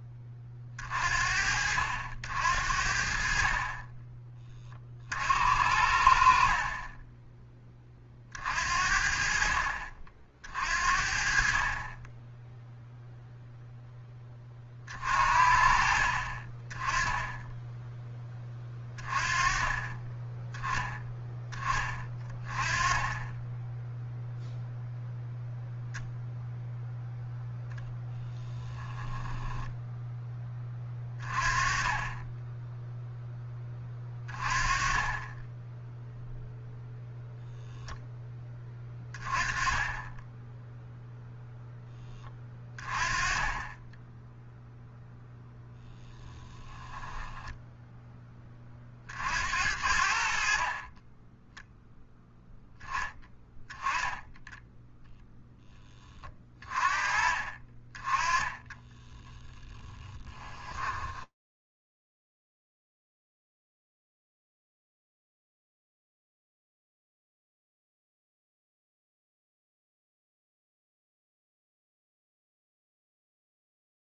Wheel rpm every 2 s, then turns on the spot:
20, 70, 30, 50, 50, 50, 10, 30, 30, 20, 10, 20, 0, 0, 10, 20, 10, 20, 0, 30, 0, 20, 0, 20, 30, 40, 10, 10, 30, 10, 10, 10, 70, 50, 0, 50, 0.
28-30 46-48 58-62